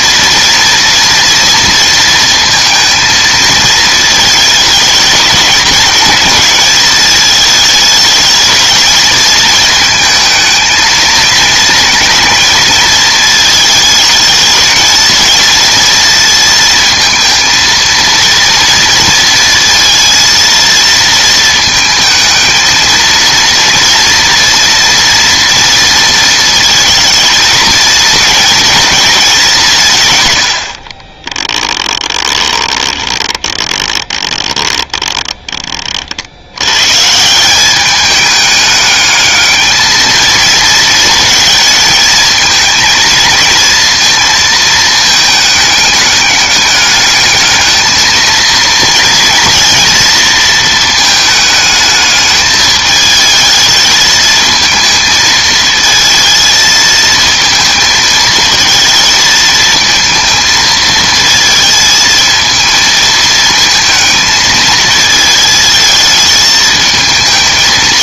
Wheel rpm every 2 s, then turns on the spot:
230, 230, 220, 220, 220, 220, 220, 220, 230, 230, 230, 220, 230, 230, 230, 70, 20, 20, 120, 210, 230, 220, 220, 210, 230, 220, 220, 220, 220, 230, 220, 220, 220, 220.
30-36